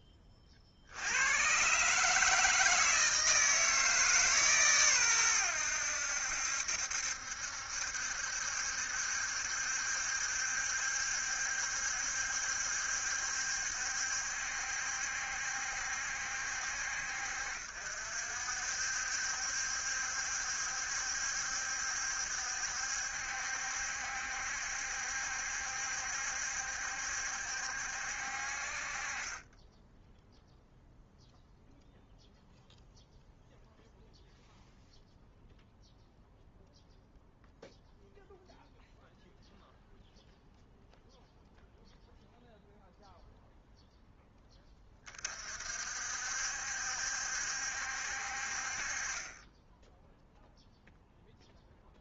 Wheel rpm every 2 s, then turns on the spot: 20, 160, 130, 70, 70, 70, 70, 70, 70, 60, 70, 70, 70, 70, 50, 0, 0, 0, 0, 0, 0, 0, 10, 60, 50, 0.
none